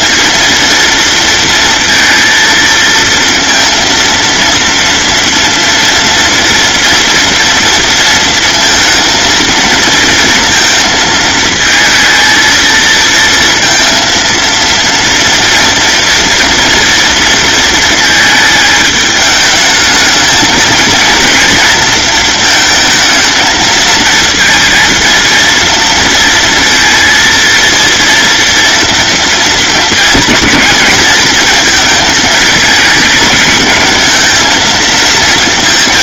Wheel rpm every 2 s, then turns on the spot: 230, 230, 230, 230, 230, 220, 230, 230, 230, 210, 230, 220, 230, 230, 230, 220, 220, 230.
none